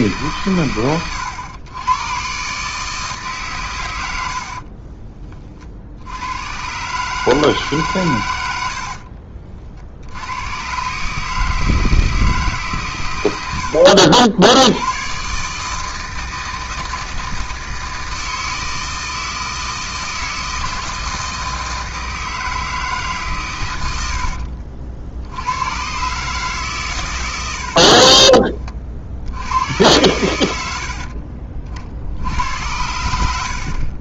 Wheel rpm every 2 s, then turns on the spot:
100, 140, 40, 120, 90, 110, 130, 90, 160, 160, 160, 160, 60, 150, 30, 80, 90.
4-6 24-26